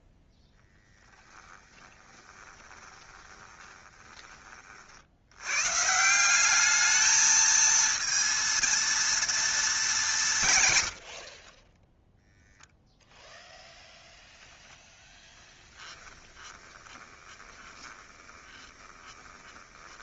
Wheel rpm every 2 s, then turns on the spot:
0, 20, 30, 200, 230, 130, 0, 0, 20, 20.
2-4 16-20